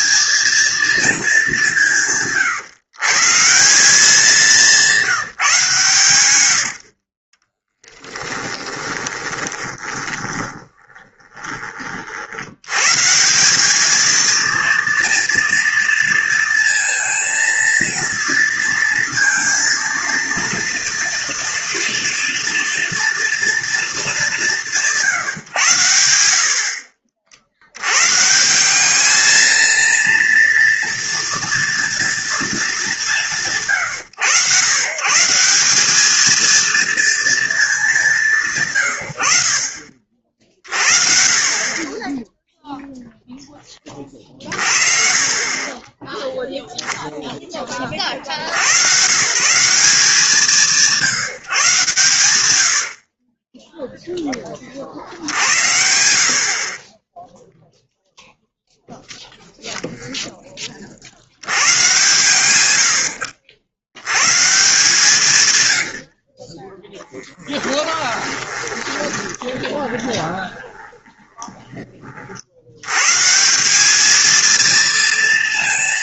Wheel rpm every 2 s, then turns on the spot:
230, 130, 190, 60, 10, 10, 130, 230, 230, 230, 230, 230, 170, 60, 200, 230, 180, 120, 230, 120, 40, 0, 40, 0, 120, 160, 90, 60, 20, 0, 50, 100, 160, 10, 20, 20, 130, 230.
8-12 68-72